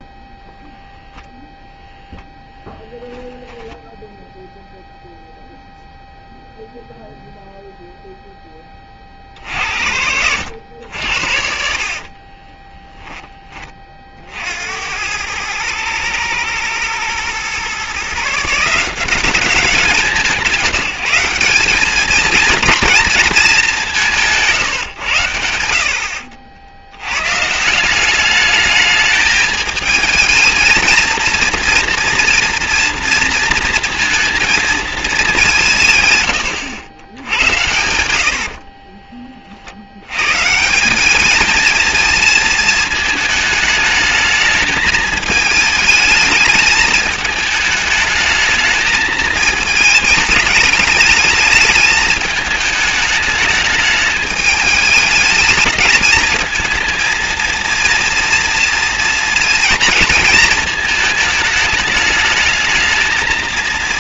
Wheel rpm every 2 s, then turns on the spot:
0, 0, 0, 0, 10, 80, 10, 80, 110, 170, 180, 220, 140, 80, 210, 220, 230, 230, 100, 40, 180, 220, 220, 210, 220, 210, 210, 210, 220, 230, 220, 220.
12-14 38-40